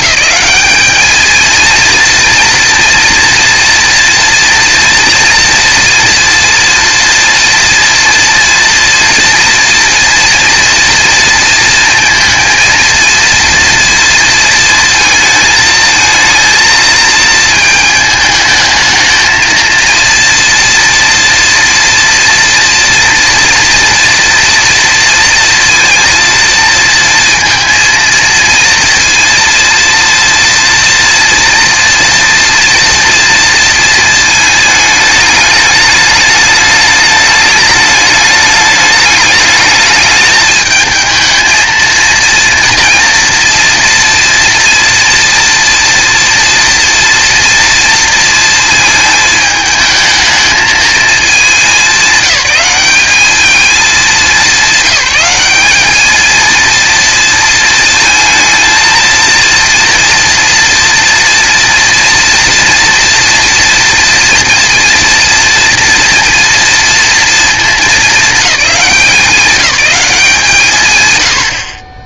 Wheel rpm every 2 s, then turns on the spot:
210, 230, 230, 230, 230, 230, 230, 230, 220, 220, 230, 230, 230, 230, 230, 230, 230, 220, 210, 210, 220, 230, 230, 230, 230, 220, 200, 200, 230, 230, 230, 230, 230, 230, 200, 160.
none